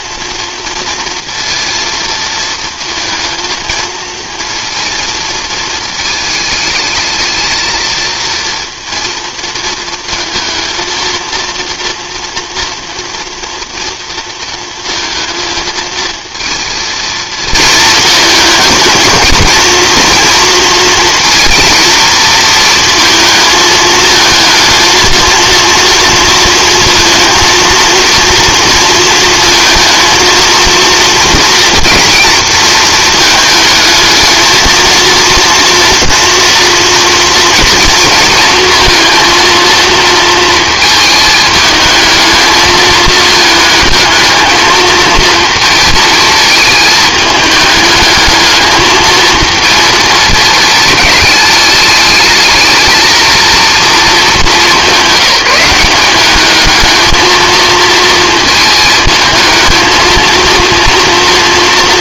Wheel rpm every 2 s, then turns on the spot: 230, 220, 230, 220, 230, 230, 230, 230, 230, 220, 230, 230, 230, 230, 230, 230, 220, 230, 230, 230, 220, 220, 220, 220, 220, 210, 220, 210, 210, 220, 230.
none